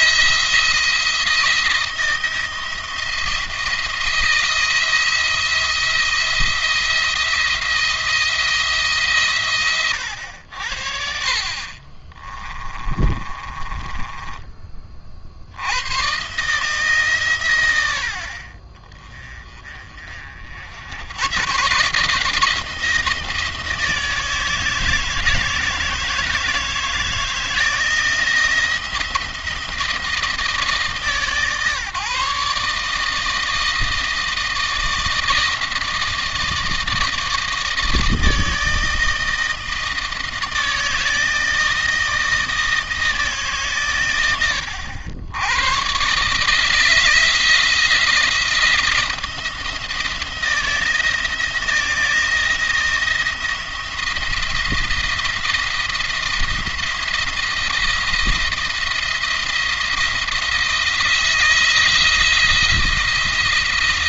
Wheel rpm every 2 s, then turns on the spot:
170, 170, 160, 170, 150, 70, 20, 30, 140, 20, 90, 170, 160, 160, 160, 150, 150, 160, 160, 160, 160, 160, 90, 160, 170, 170, 170, 170, 170, 170, 170, 170.
12-14